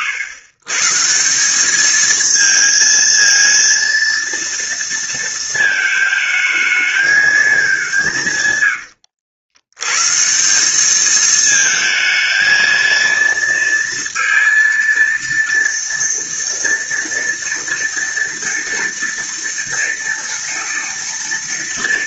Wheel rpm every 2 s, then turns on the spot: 130, 230, 230, 220, 130, 190, 230, 230, 230, 230, 240.
8-10